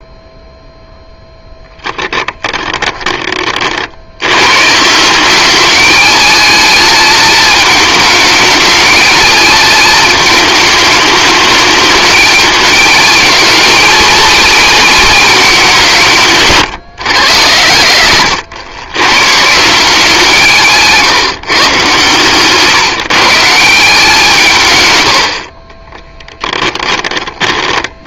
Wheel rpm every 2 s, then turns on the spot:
0, 20, 160, 220, 220, 210, 220, 240, 140, 120, 160, 150, 120, 20.
26-28